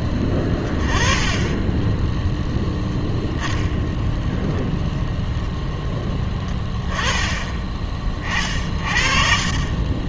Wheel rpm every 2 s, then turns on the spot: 10, 0, 0, 10, 40.
6-8